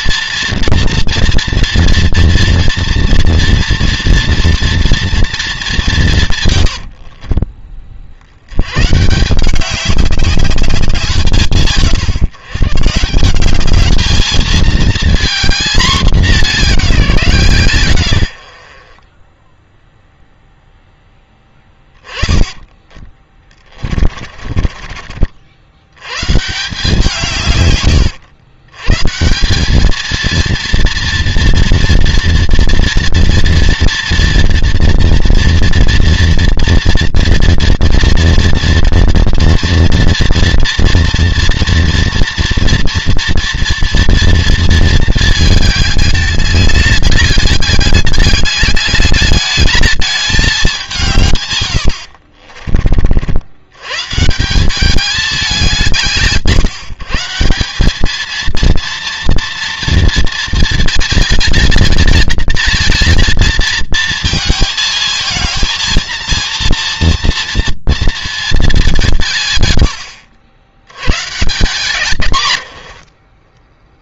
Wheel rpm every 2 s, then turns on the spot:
230, 230, 230, 110, 90, 200, 140, 220, 210, 70, 0, 20, 40, 150, 110, 230, 240, 230, 230, 230, 230, 230, 230, 210, 200, 200, 50, 170, 150, 220, 230, 230, 230, 230, 210, 90, 110.
6-8 22-26 52-54 72-74